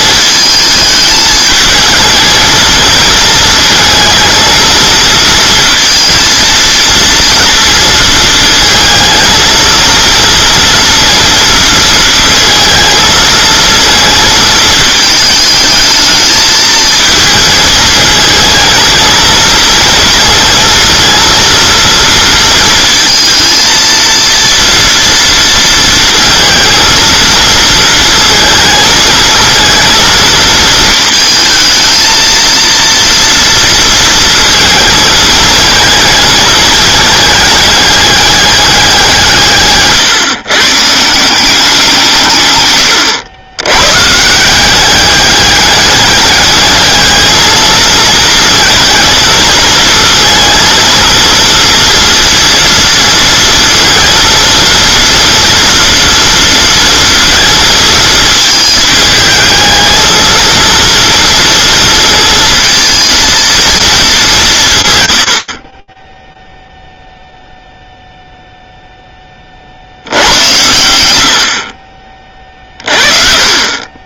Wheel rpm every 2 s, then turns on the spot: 220, 220, 230, 230, 230, 230, 230, 220, 220, 220, 230, 230, 230, 230, 220, 220, 230, 230, 220, 200, 150, 110, 190, 210, 230, 230, 230, 230, 230, 220, 230, 230, 130, 0, 0, 100, 40.
72-74